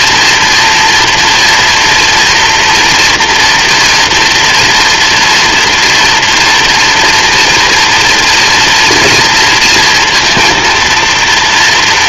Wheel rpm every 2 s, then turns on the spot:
240, 230, 240, 230, 230, 230.
none